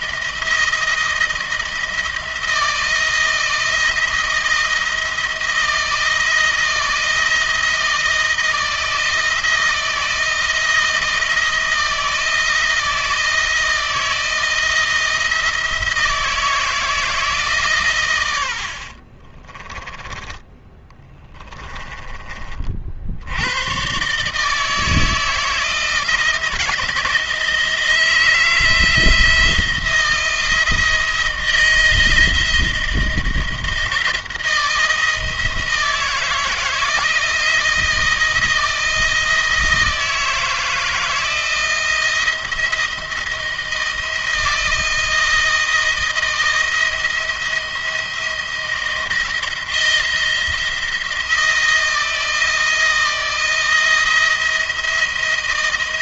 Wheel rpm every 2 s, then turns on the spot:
170, 170, 170, 170, 160, 170, 160, 170, 160, 80, 20, 40, 150, 160, 170, 170, 160, 160, 160, 160, 160, 170, 160, 160, 170, 170, 160, 170.
20-22